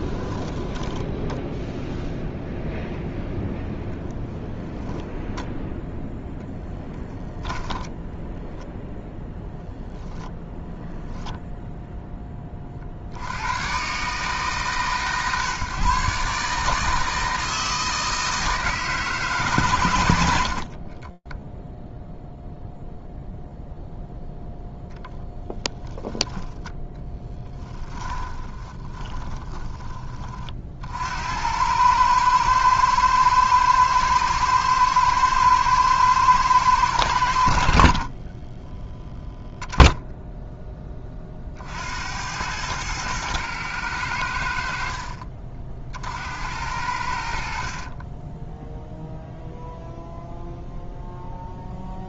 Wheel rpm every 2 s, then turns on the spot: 10, 0, 10, 10, 0, 0, 70, 130, 160, 150, 10, 0, 0, 10, 20, 70, 110, 110, 80, 10, 40, 110, 40, 60, 0, 0.
0-2 4-8 20-22 26-30